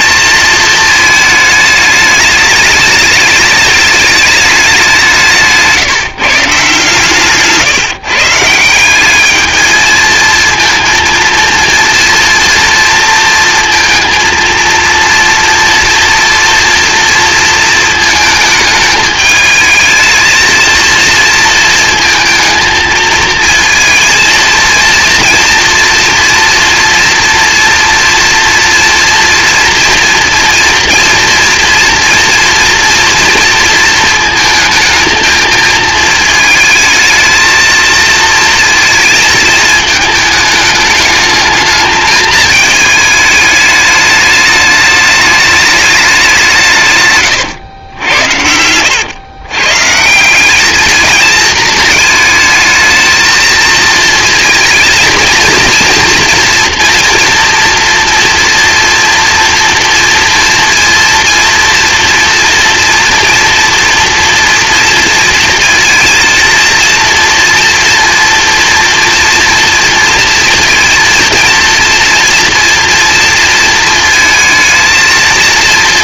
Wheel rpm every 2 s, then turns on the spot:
220, 210, 190, 140, 180, 230, 230, 230, 230, 220, 230, 220, 230, 240, 230, 230, 230, 220, 220, 230, 210, 220, 210, 150, 100, 220, 220, 230, 230, 230, 230, 230, 230, 230, 230, 230, 240, 230.
none